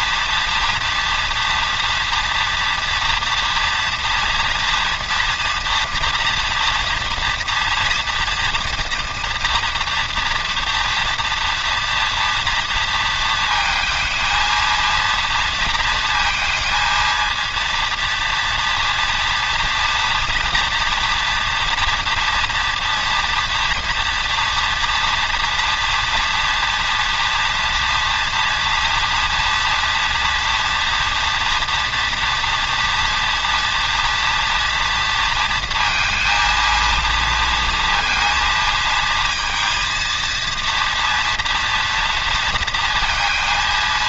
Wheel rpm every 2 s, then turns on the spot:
230, 240, 240, 230, 230, 240, 230, 230, 230, 240, 230, 230, 230, 230, 230, 230, 230, 230, 230, 230, 230, 230.
none